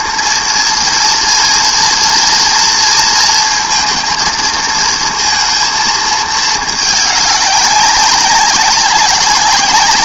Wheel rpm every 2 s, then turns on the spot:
230, 230, 230, 220, 200.
none